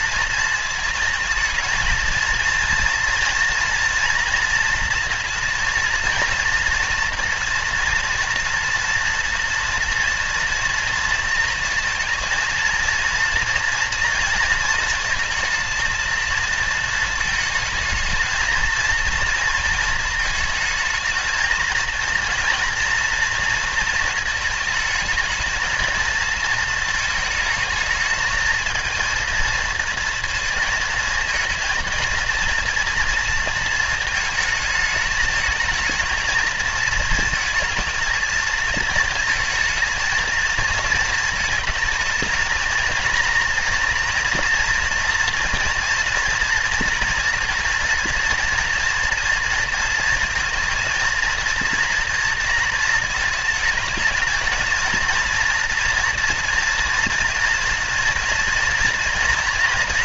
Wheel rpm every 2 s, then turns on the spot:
220, 230, 240, 240, 240, 230, 230, 230, 230, 230, 220, 230, 220, 220, 230, 230, 230, 210, 230, 220, 220, 230, 230, 230, 230, 230, 230, 230, 240, 230.
none